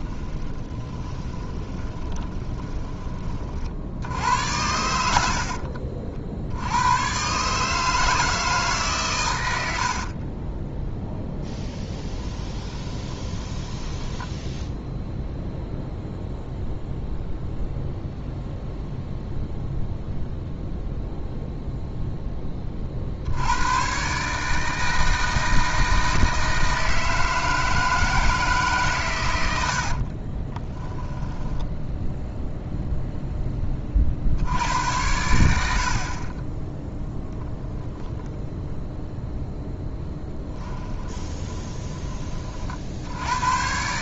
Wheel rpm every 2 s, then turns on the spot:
20, 20, 80, 120, 130, 0, 20, 0, 0, 0, 0, 50, 160, 160, 120, 10, 0, 90, 10, 0, 20, 60.
0-2 12-14 30-32 40-42